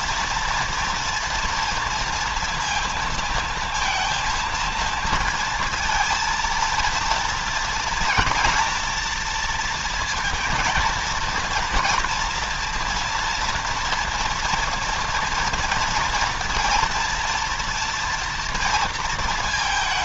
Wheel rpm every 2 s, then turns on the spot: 230, 230, 230, 230, 240, 230, 230, 240, 230, 230.
none